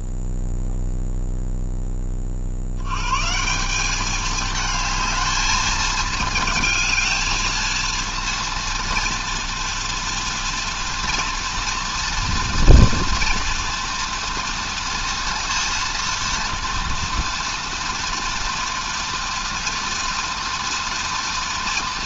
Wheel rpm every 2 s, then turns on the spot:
0, 70, 220, 220, 230, 230, 240, 230, 230, 230, 230.
none